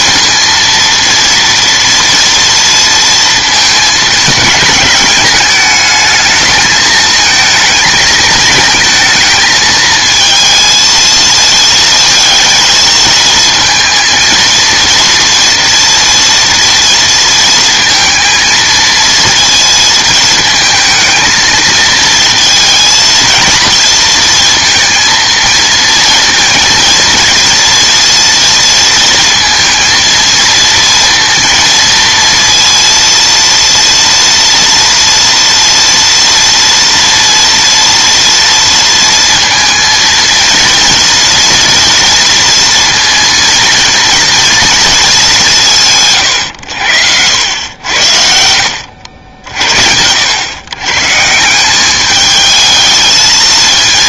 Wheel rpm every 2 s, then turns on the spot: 230, 230, 210, 220, 220, 220, 220, 230, 230, 230, 220, 230, 220, 220, 230, 230, 230, 230, 230, 230, 230, 230, 220, 80, 80, 130, 220.
none